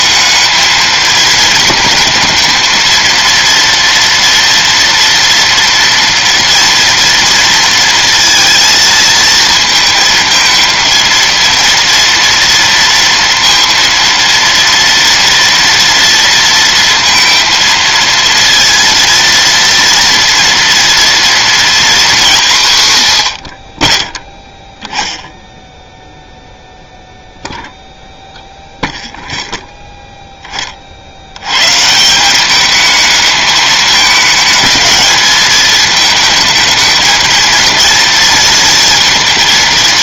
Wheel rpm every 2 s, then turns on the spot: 220, 220, 230, 230, 230, 220, 230, 230, 230, 230, 230, 180, 10, 0, 0, 20, 200, 210, 220, 230.
none